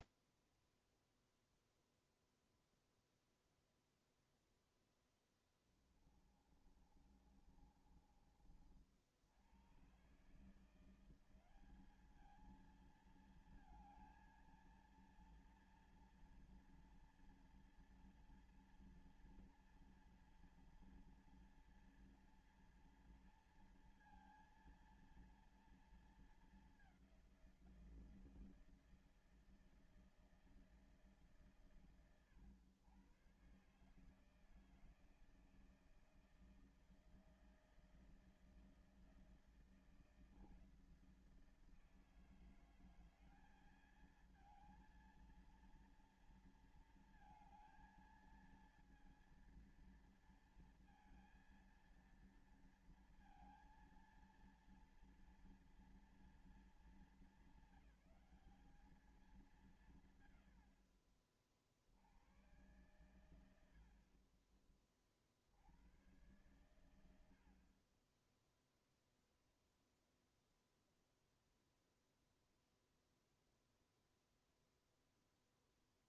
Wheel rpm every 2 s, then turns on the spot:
0, 0, 0, 30, 50, 150, 220, 230, 230, 230, 230, 230, 230, 210, 170, 160, 100, 160, 160, 160, 160, 170, 220, 230, 230, 230, 230, 230, 220, 200, 90, 100, 40, 100, 10, 0, 0, 0.
6-8